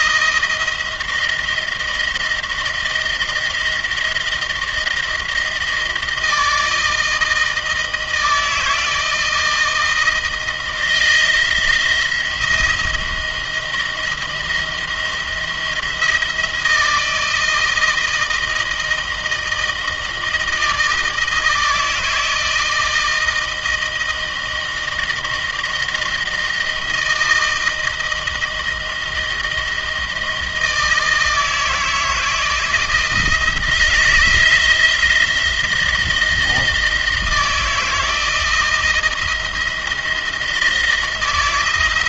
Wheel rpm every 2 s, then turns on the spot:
160, 160, 170, 160, 160, 160, 170, 170, 160, 160, 160, 160, 160, 170, 160, 160, 160, 170, 160, 160, 160.
none